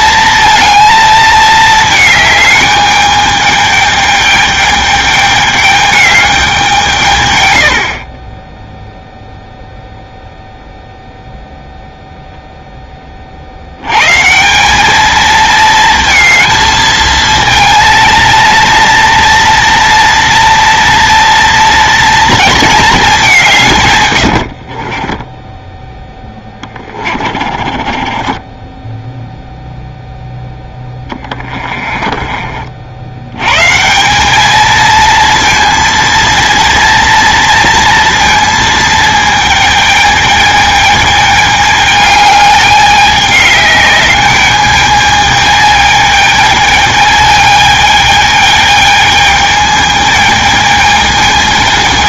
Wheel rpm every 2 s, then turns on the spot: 230, 210, 210, 180, 10, 0, 0, 190, 220, 230, 230, 230, 70, 20, 20, 10, 40, 220, 230, 230, 210, 210, 210, 220, 220, 220.
24-32